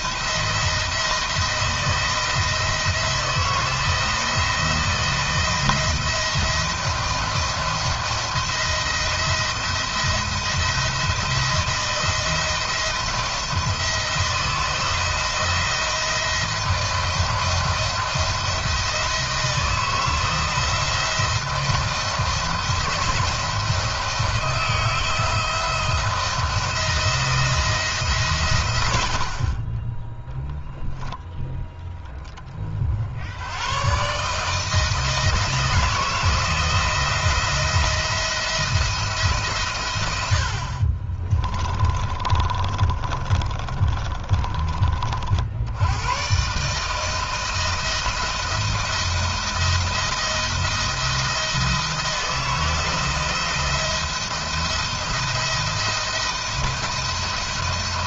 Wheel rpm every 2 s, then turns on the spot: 160, 160, 170, 170, 170, 170, 170, 170, 170, 160, 170, 170, 170, 170, 50, 10, 90, 160, 170, 140, 20, 30, 60, 160, 170, 170, 170, 170, 170.
40-44